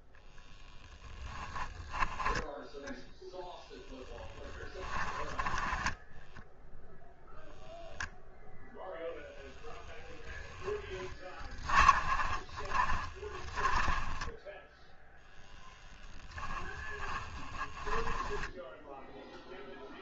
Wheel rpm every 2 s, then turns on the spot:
0, 10, 10, 0, 0, 20, 20, 10, 10, 10.
4-6 10-14 16-18